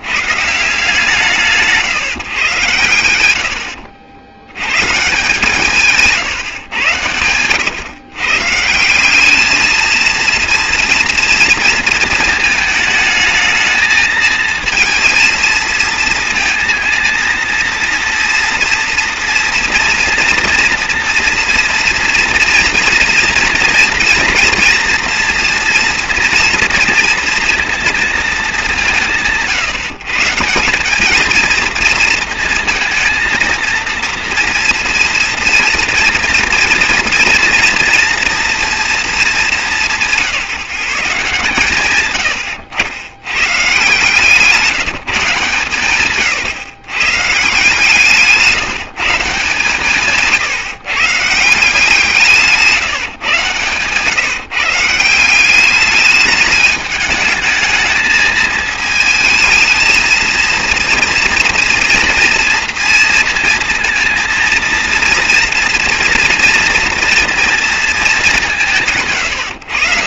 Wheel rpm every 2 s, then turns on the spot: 170, 130, 120, 130, 160, 230, 220, 220, 230, 230, 230, 230, 230, 230, 200, 190, 230, 230, 230, 230, 170, 80, 170, 130, 170, 140, 150, 150, 210, 220, 230, 230, 230, 230, 160.
52-54